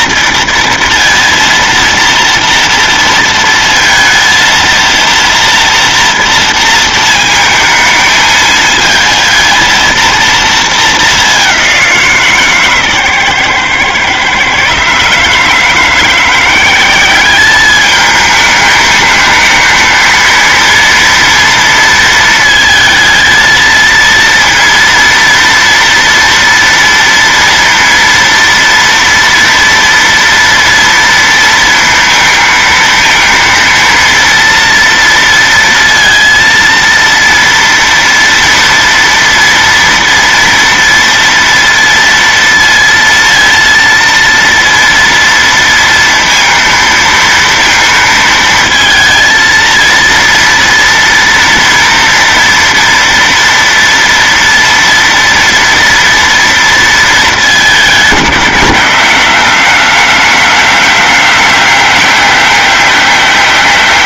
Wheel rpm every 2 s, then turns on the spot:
230, 230, 230, 230, 220, 220, 150, 130, 180, 220, 220, 230, 230, 230, 230, 230, 230, 230, 230, 230, 240, 230, 230, 230, 230, 230, 230, 230, 230, 180, 190, 190.
none